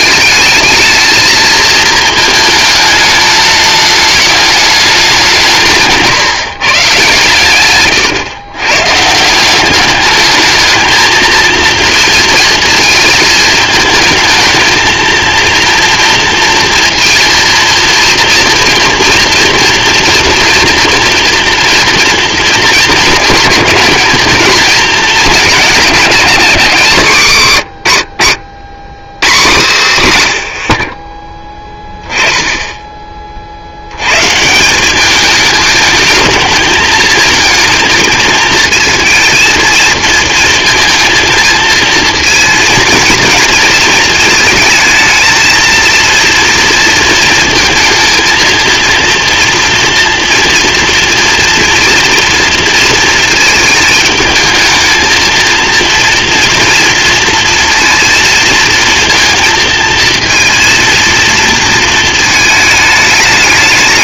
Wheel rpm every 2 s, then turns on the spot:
220, 220, 200, 130, 130, 220, 230, 220, 230, 230, 230, 220, 220, 180, 120, 60, 20, 180, 220, 230, 220, 230, 220, 230, 230, 230, 230, 220, 240, 230, 230, 210.
none